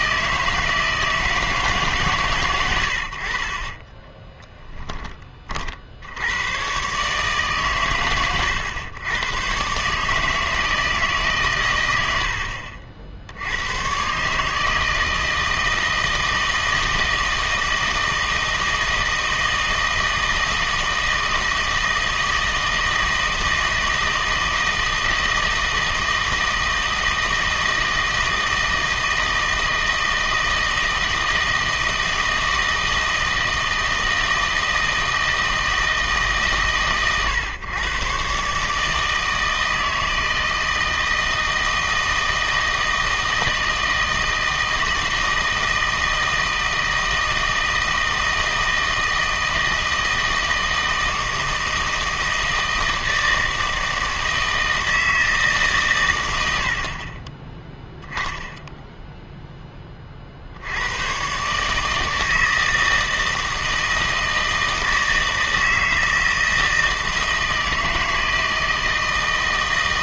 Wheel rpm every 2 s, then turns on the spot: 160, 100, 10, 120, 120, 160, 60, 150, 160, 160, 160, 160, 160, 160, 160, 160, 160, 160, 140, 150, 160, 160, 160, 160, 160, 160, 160, 160, 70, 0, 90, 160, 160, 160, 160.
none